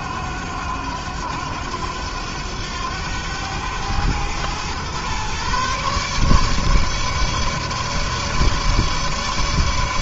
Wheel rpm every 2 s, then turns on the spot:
90, 100, 110, 140, 150.
none